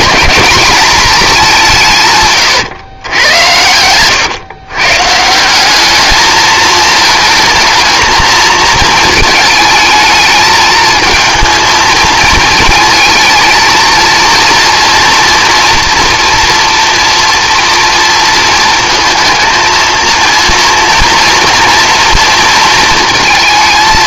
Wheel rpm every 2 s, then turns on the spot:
210, 120, 120, 220, 230, 220, 220, 240, 240, 230, 230, 220.
none